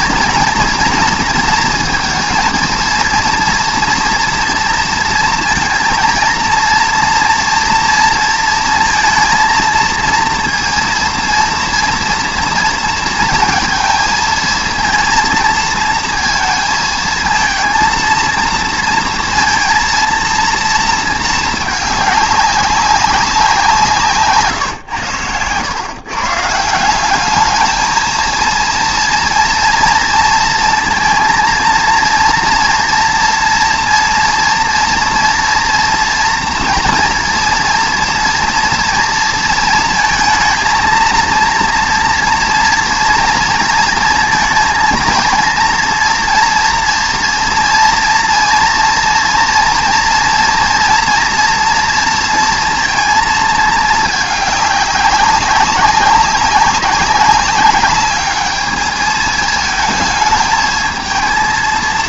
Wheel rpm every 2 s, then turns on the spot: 230, 230, 230, 230, 230, 230, 230, 220, 220, 230, 230, 200, 130, 160, 230, 230, 230, 240, 240, 230, 230, 230, 230, 230, 230, 230, 230, 210, 200, 210, 220.
none